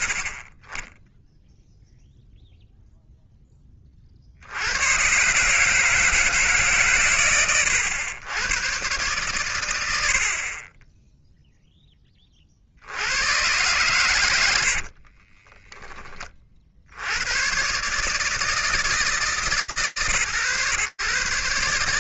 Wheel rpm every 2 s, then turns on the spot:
50, 0, 120, 130, 120, 10, 110, 40, 110, 140, 130.
14-16